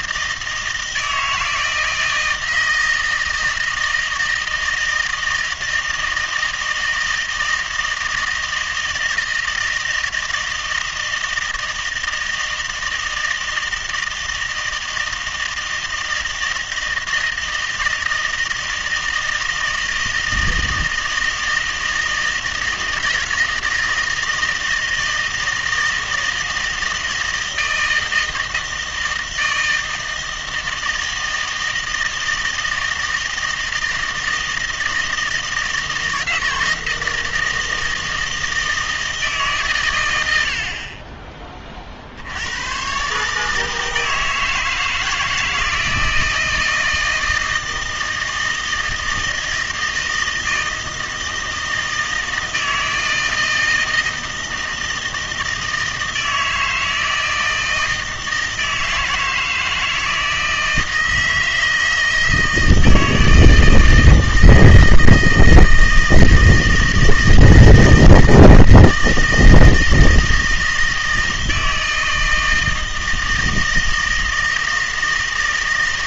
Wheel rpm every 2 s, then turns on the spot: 160, 160, 160, 160, 160, 160, 160, 160, 160, 160, 160, 160, 160, 160, 160, 160, 160, 160, 160, 160, 60, 100, 160, 160, 160, 160, 160, 160, 160, 160, 160, 160, 160, 160, 160, 160, 160, 160.
none